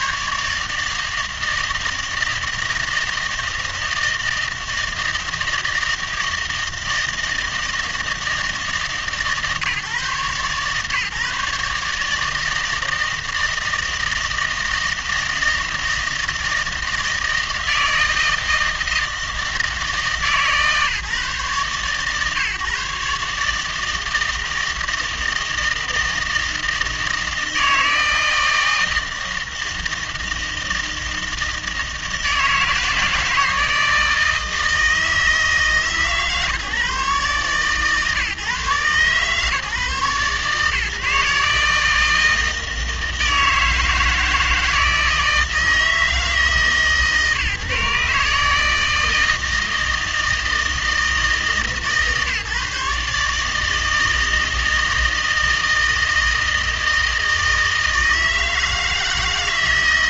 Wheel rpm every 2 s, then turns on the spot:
150, 160, 160, 160, 160, 150, 160, 160, 160, 160, 140, 140, 160, 160, 160, 160, 160, 160, 140, 140, 140, 160, 160, 150, 150, 160, 150, 160, 160, 160.
none